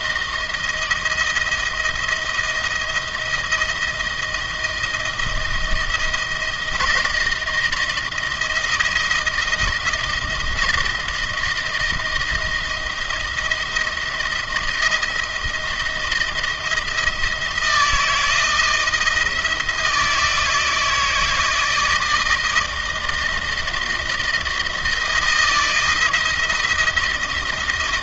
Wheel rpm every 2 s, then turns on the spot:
160, 170, 160, 160, 160, 160, 160, 160, 170, 160, 160, 160, 160, 170.
none